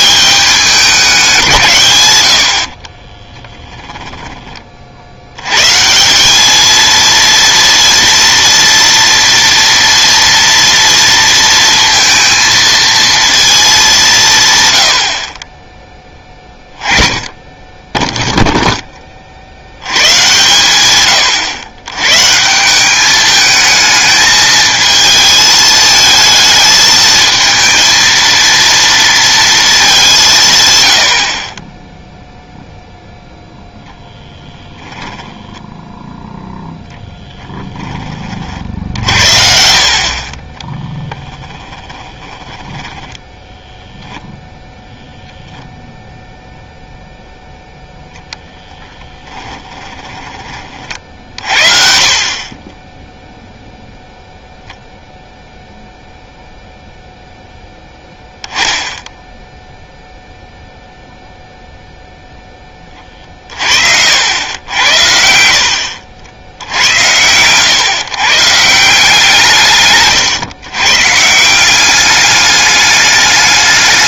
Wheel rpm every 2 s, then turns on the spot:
200, 50, 40, 220, 230, 230, 230, 100, 20, 10, 130, 170, 220, 220, 220, 120, 0, 10, 0, 60, 10, 10, 0, 0, 10, 40, 30, 0, 0, 10, 0, 20, 80, 80, 170, 120, 210.
2-4 40-44 48-50